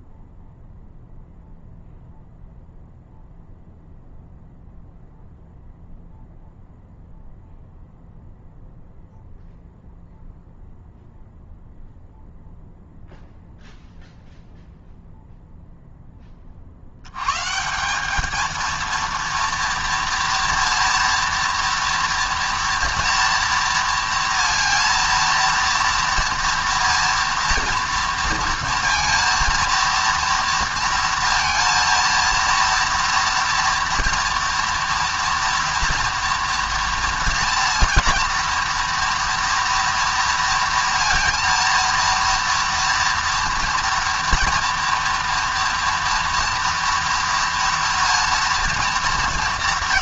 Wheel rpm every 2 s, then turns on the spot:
0, 0, 0, 0, 0, 0, 0, 0, 60, 230, 230, 230, 230, 230, 230, 230, 230, 230, 230, 230, 230, 230, 230, 240, 230.
none